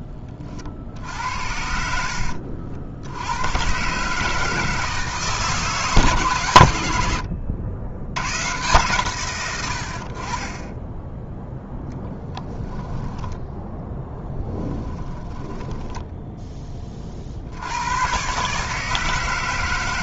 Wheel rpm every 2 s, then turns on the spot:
50, 70, 150, 100, 140, 20, 10, 10, 40, 150.
14-16